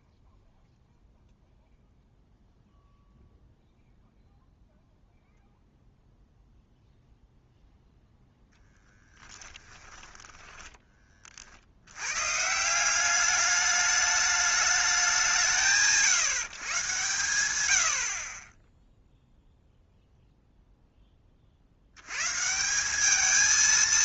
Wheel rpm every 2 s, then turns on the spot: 0, 0, 0, 0, 10, 10, 150, 210, 140, 20, 0, 160.
none